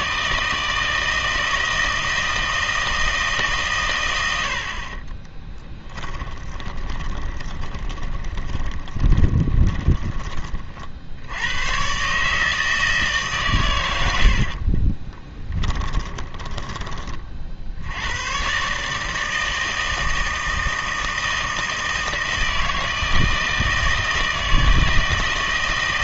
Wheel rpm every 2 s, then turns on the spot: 160, 160, 40, 20, 20, 60, 150, 20, 30, 150, 160, 160, 160.
4-10 14-16